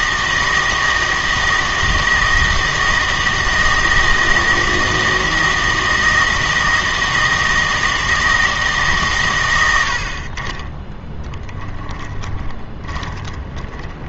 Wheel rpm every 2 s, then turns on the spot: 160, 160, 160, 160, 150, 30, 20.
12-14